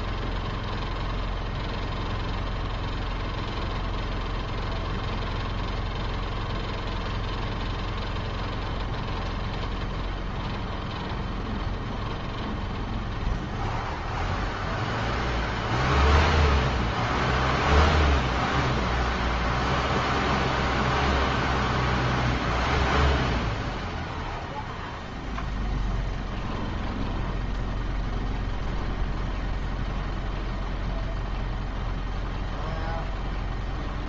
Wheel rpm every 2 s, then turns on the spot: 0, 0, 0, 0, 0, 0, 0, 0, 0, 0, 0, 0, 0, 0, 0, 0, 0.
none